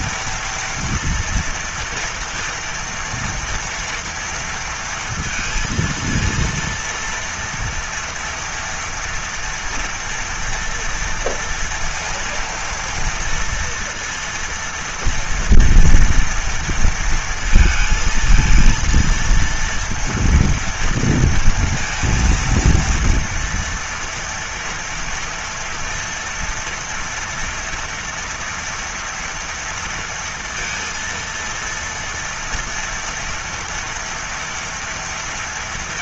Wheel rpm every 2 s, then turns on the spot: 230, 230, 230, 230, 230, 240, 230, 230, 230, 230, 230, 230, 230, 230, 230, 230, 230, 230.
none